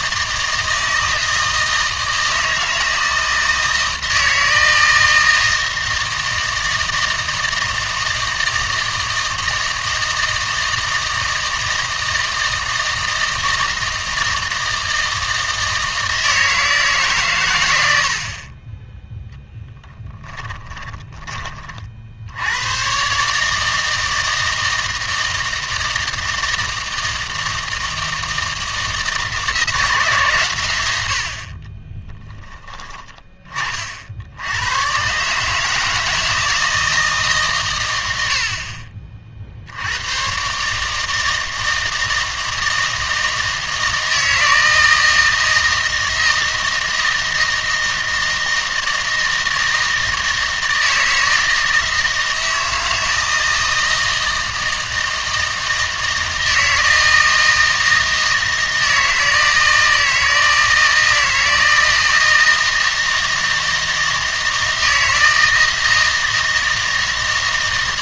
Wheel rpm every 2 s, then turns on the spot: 160, 160, 160, 160, 160, 160, 160, 160, 160, 30, 20, 100, 160, 160, 160, 120, 10, 90, 160, 60, 130, 160, 160, 160, 160, 160, 160, 160, 160, 160, 160, 160, 160, 160.
20-22